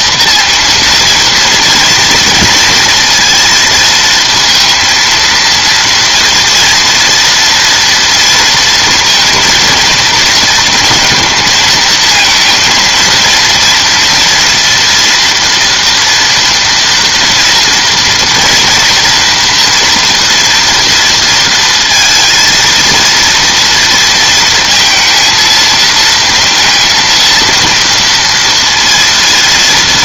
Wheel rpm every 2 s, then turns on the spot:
230, 230, 230, 230, 230, 230, 230, 230, 230, 240, 230, 230, 230, 230, 230.
none